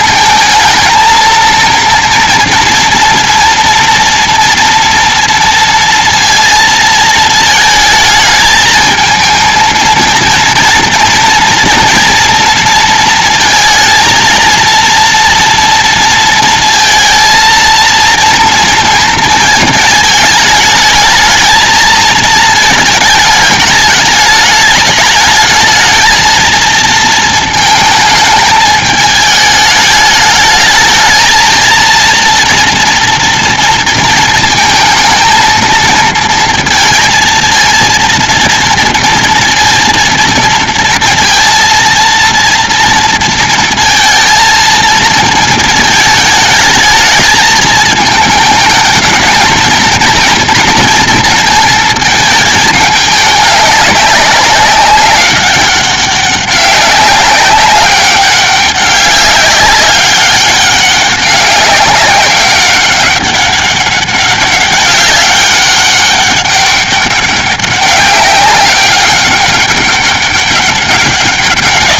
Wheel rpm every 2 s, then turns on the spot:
230, 230, 230, 230, 220, 230, 230, 230, 230, 240, 220, 220, 210, 220, 210, 220, 230, 220, 230, 230, 230, 230, 230, 220, 210, 230, 210, 200, 190, 200, 200, 200, 200, 200, 190, 200.
none